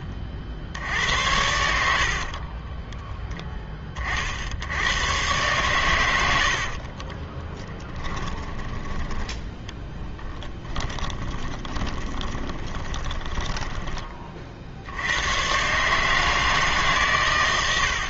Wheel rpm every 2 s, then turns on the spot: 60, 20, 90, 60, 10, 20, 20, 70, 150.
2-4 6-14